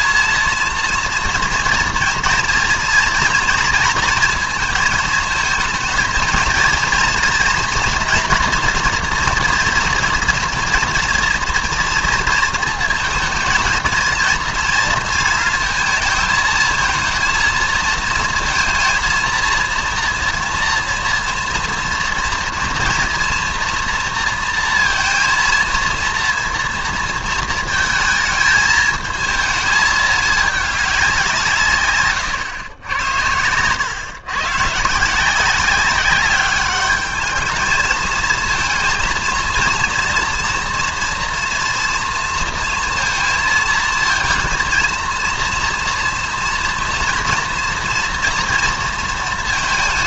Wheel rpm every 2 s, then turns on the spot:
230, 230, 220, 230, 240, 230, 230, 230, 230, 230, 230, 230, 230, 230, 220, 200, 90, 150, 210, 230, 230, 230, 230, 230, 230.
none